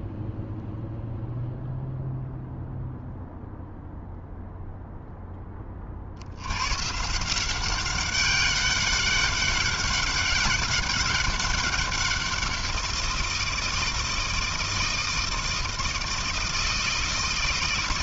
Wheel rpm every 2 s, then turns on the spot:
0, 0, 10, 170, 200, 190, 170, 160, 160.
none